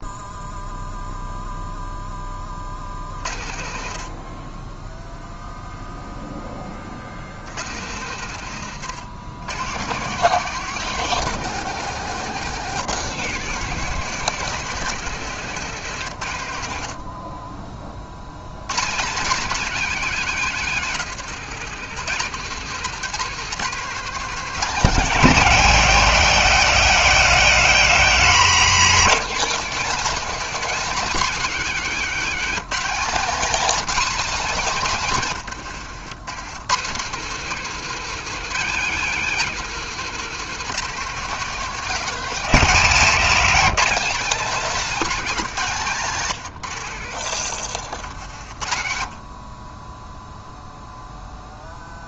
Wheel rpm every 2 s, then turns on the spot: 0, 60, 0, 60, 110, 160, 160, 160, 30, 210, 160, 190, 190, 180, 210, 240, 230, 160, 180, 210, 200, 210, 240, 80, 50, 0.
none